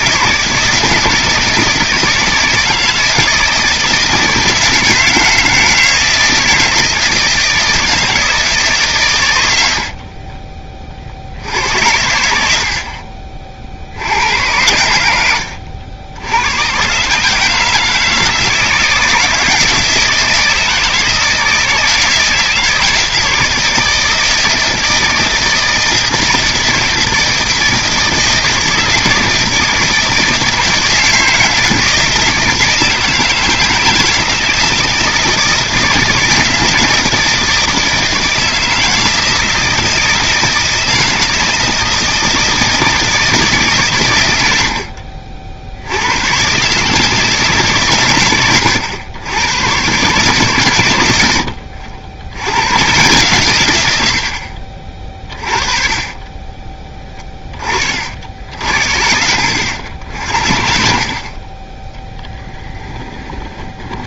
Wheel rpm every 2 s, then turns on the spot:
160, 160, 160, 160, 130, 30, 70, 90, 120, 160, 160, 160, 160, 160, 160, 160, 160, 160, 160, 160, 160, 160, 70, 140, 110, 120, 110, 50, 20, 60, 60, 10.
62-64